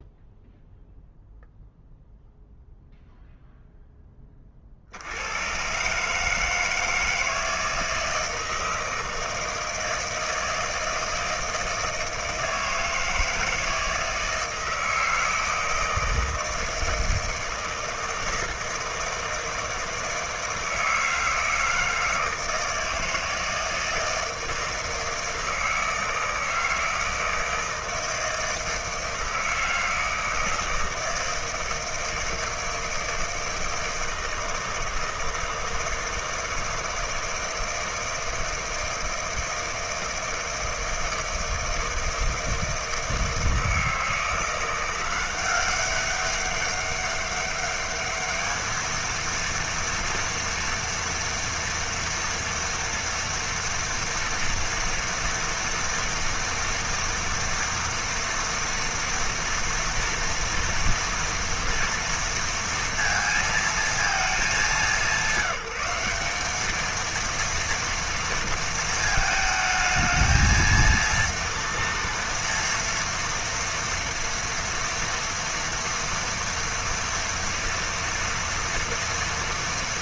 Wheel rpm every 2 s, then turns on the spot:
0, 0, 90, 160, 160, 160, 160, 160, 160, 160, 160, 160, 160, 160, 160, 160, 160, 160, 160, 160, 160, 160, 180, 200, 230, 230, 230, 230, 230, 230, 230, 230, 170, 230, 220, 230, 240, 230, 230, 240.
none